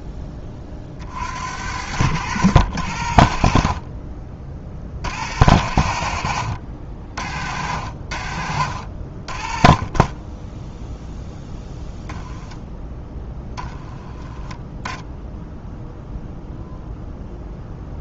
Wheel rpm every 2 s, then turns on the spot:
40, 80, 60, 50, 50, 0, 10, 10, 0.
none